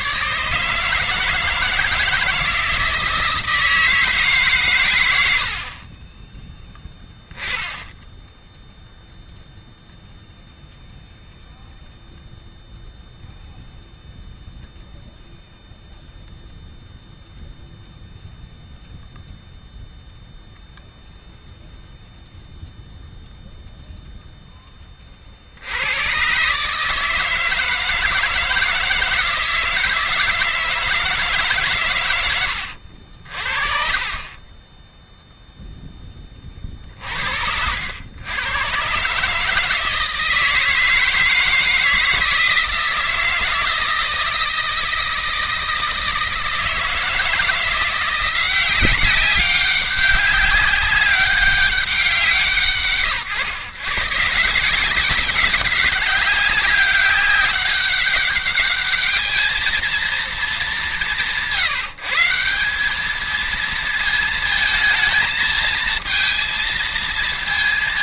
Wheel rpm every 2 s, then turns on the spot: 150, 170, 130, 10, 0, 0, 0, 0, 0, 0, 0, 0, 20, 150, 160, 160, 80, 10, 30, 120, 160, 160, 160, 160, 190, 200, 140, 180, 190, 210, 200, 190, 220, 220.
none